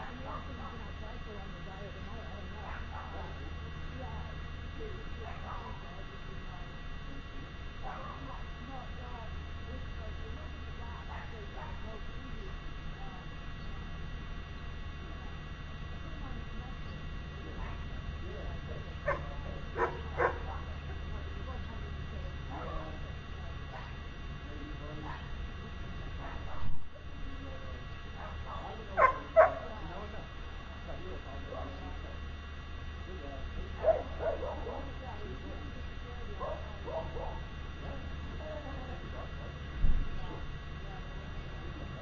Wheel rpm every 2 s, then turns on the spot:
0, 0, 0, 0, 0, 0, 0, 0, 0, 0, 0, 0, 0, 0, 0, 0, 0, 0, 0, 0, 0.
none